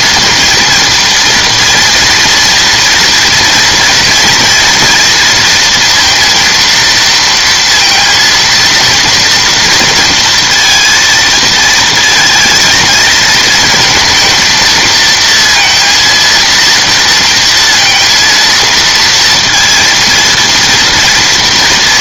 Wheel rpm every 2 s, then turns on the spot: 230, 230, 230, 230, 230, 230, 220, 220, 230, 230, 230.
none